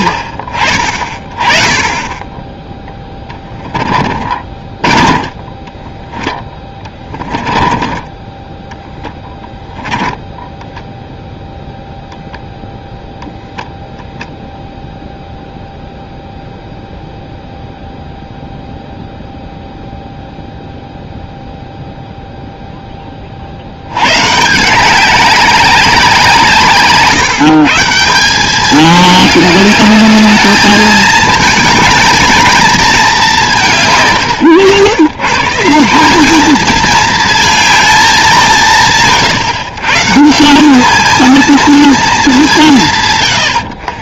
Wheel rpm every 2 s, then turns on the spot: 30, 10, 30, 20, 10, 0, 0, 0, 0, 0, 0, 0, 170, 160, 200, 210, 220, 90, 210, 180, 190, 170.
2-8